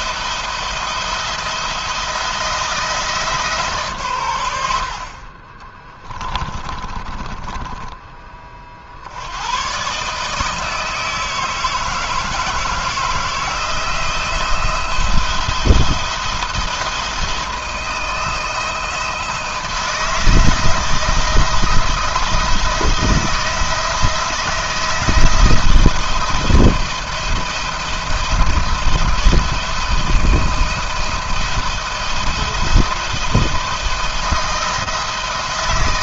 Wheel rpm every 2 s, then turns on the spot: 170, 160, 70, 20, 50, 160, 160, 170, 170, 170, 160, 170, 160, 170, 170, 160, 170, 170.
6-8